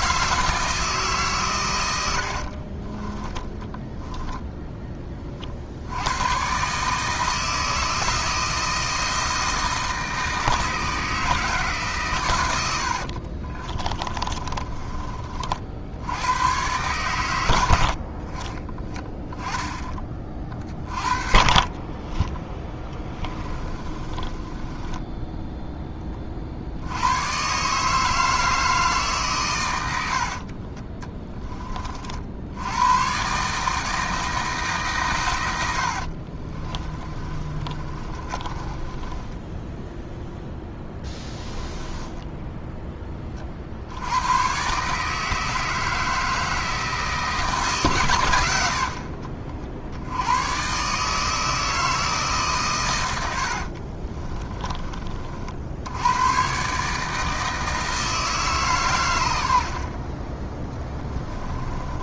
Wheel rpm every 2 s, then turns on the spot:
160, 40, 10, 140, 160, 160, 80, 30, 110, 20, 40, 10, 20, 70, 150, 40, 110, 140, 30, 20, 10, 10, 140, 160, 70, 140, 110, 30, 140, 130, 10.
2-4 12-16 20-26 36-42 48-50 60-62